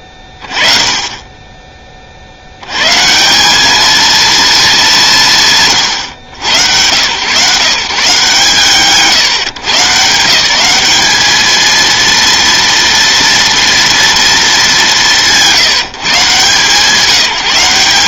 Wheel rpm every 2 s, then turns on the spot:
30, 120, 220, 110, 160, 180, 230, 210, 150.
none